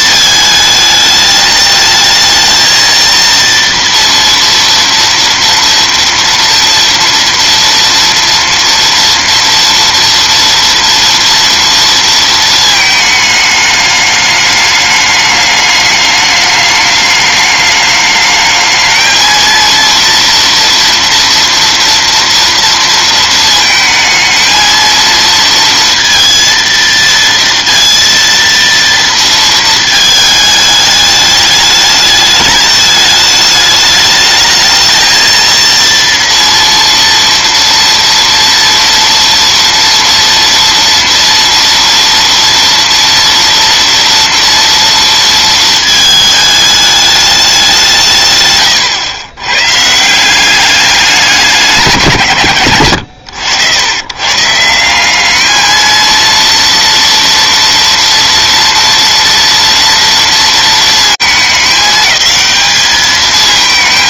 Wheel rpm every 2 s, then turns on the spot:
220, 220, 230, 230, 230, 230, 230, 210, 210, 210, 230, 230, 220, 230, 230, 220, 210, 210, 230, 240, 240, 230, 230, 220, 150, 160, 140, 130, 230, 230, 230, 210.
none